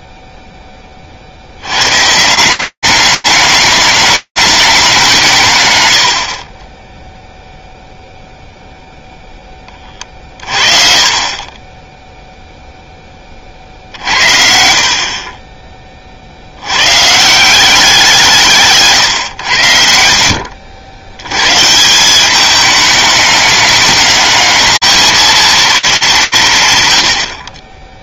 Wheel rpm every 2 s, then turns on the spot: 120, 200, 70, 0, 40, 10, 60, 30, 180, 70, 170, 210, 210, 20.
none